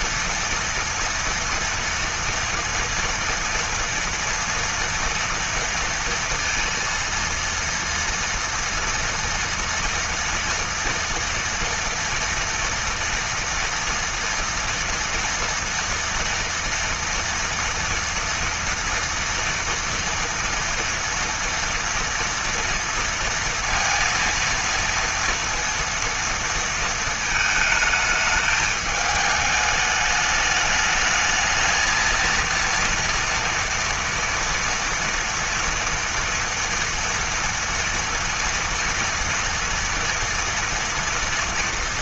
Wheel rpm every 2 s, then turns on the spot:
230, 230, 240, 230, 230, 230, 230, 230, 230, 230, 230, 230, 230, 230, 220, 210, 230, 230, 230, 230, 230.
none